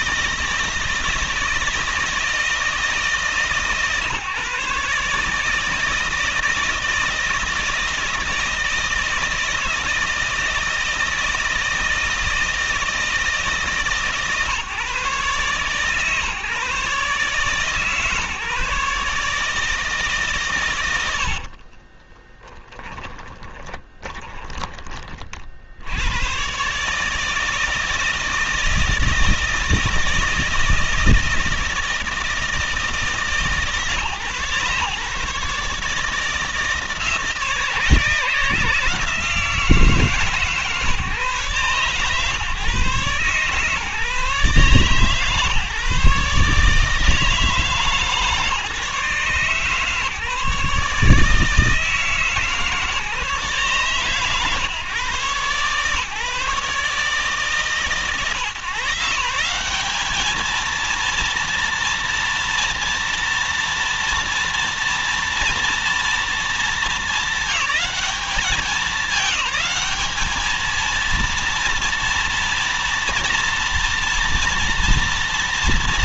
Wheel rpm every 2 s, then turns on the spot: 160, 160, 150, 160, 160, 160, 160, 140, 140, 150, 120, 20, 20, 130, 170, 160, 160, 140, 160, 160, 140, 140, 140, 150, 150, 150, 150, 140, 150, 160, 230, 230, 230, 210, 210, 230, 230, 230.
22-26